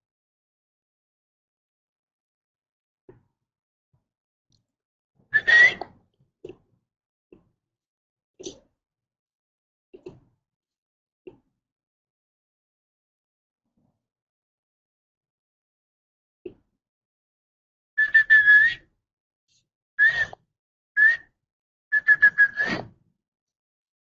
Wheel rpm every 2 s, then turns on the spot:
0, 0, 0, 0, 0, 0, 0, 0, 0, 0, 0, 0.
none